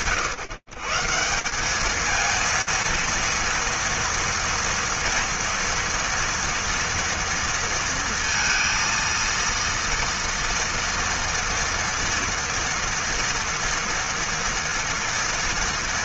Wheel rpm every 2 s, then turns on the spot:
140, 230, 230, 230, 230, 230, 230, 230.
none